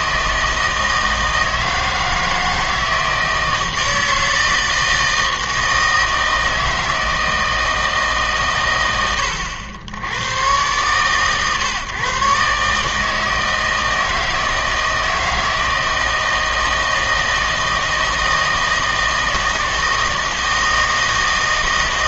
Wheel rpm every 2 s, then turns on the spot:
160, 160, 160, 160, 110, 120, 150, 160, 160, 160, 160.
none